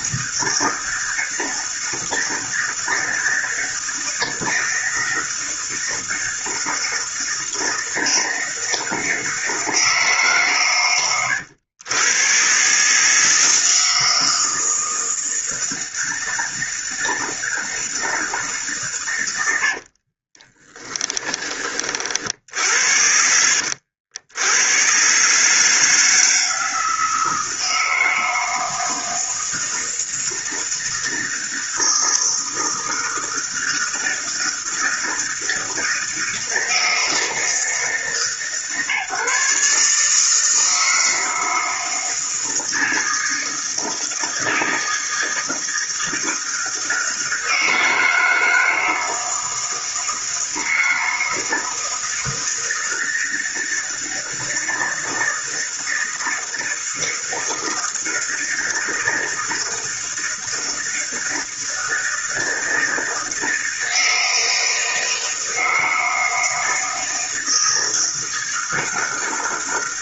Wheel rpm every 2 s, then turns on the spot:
160, 160, 160, 160, 160, 130, 130, 160, 160, 150, 30, 60, 90, 160, 160, 160, 160, 160, 160, 150, 160, 160, 160, 160, 160, 160, 160, 160, 160, 160, 160, 160, 160, 160, 160.
20-22